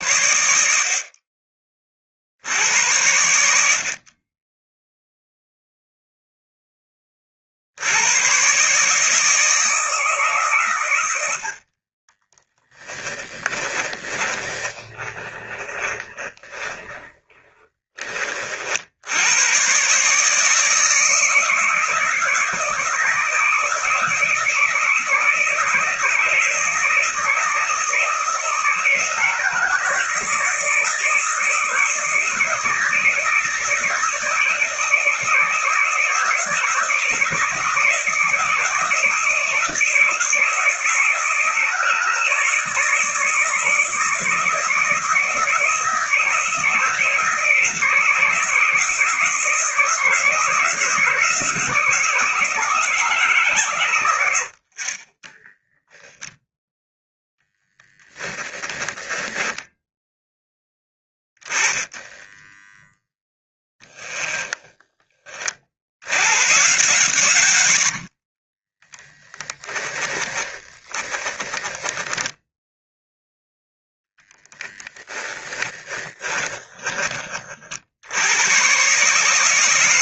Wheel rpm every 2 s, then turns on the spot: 70, 90, 10, 20, 140, 110, 20, 30, 20, 60, 160, 160, 160, 170, 160, 160, 160, 160, 160, 160, 160, 170, 160, 160, 160, 160, 160, 50, 0, 10, 20, 10, 20, 130, 20, 10, 0, 10, 30, 130.
12-18 54-56 58-62 68-72 76-78